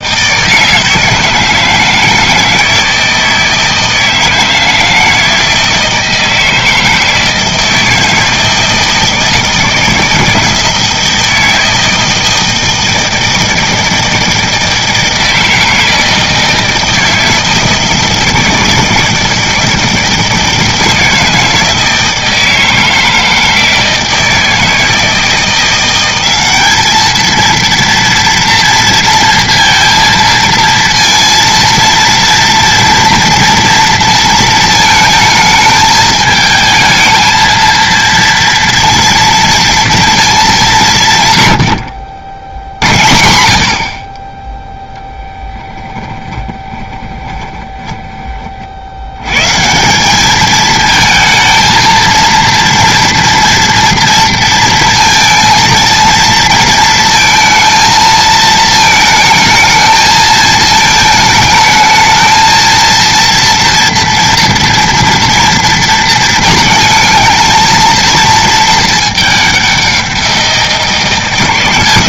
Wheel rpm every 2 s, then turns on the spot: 160, 160, 160, 160, 160, 160, 160, 160, 160, 160, 160, 160, 160, 210, 230, 230, 230, 220, 220, 230, 200, 80, 0, 20, 60, 220, 230, 230, 230, 220, 220, 220, 230, 230, 220, 170.
46-48